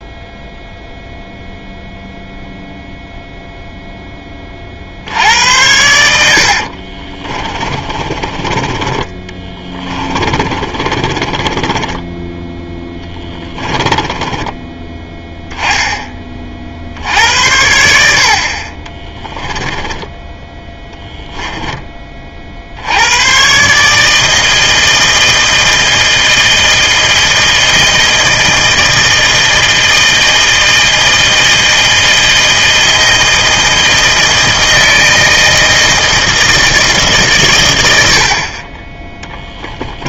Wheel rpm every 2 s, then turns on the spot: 0, 0, 50, 50, 20, 30, 10, 10, 50, 40, 10, 70, 160, 160, 160, 160, 160, 160, 160, 30.
6-14 20-22